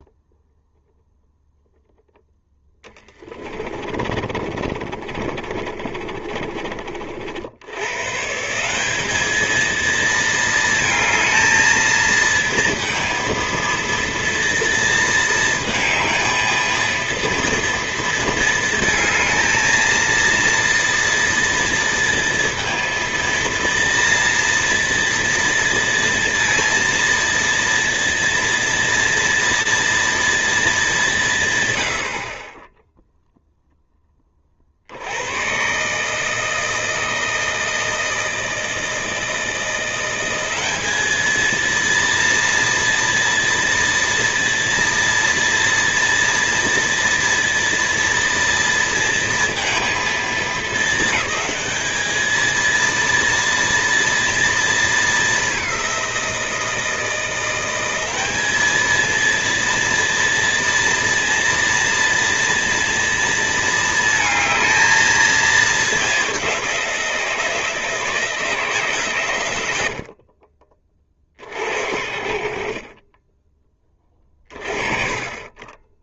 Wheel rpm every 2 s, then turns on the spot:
0, 10, 30, 40, 180, 220, 230, 230, 230, 230, 230, 230, 230, 230, 240, 210, 10, 60, 160, 160, 200, 230, 230, 230, 230, 220, 230, 220, 170, 220, 230, 230, 220, 180, 150, 30, 40, 30.
2-8